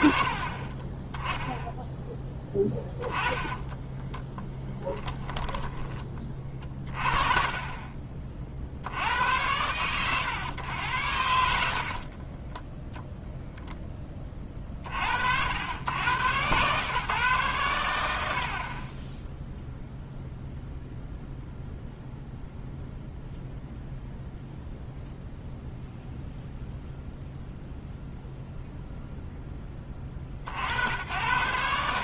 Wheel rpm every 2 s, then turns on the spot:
30, 20, 10, 30, 70, 110, 10, 50, 140, 30, 0, 0, 0, 0, 0, 90.
2-6 12-14